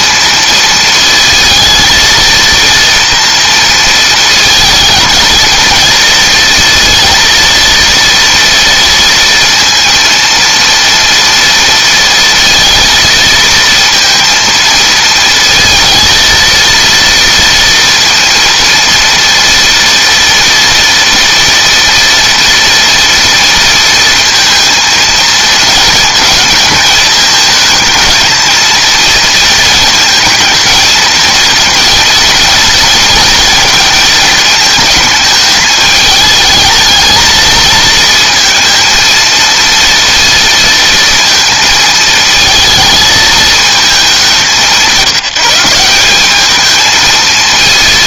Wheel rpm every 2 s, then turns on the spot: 230, 230, 220, 230, 230, 230, 230, 230, 230, 230, 230, 230, 230, 220, 230, 220, 230, 220, 220, 230, 230, 220, 180, 220.
none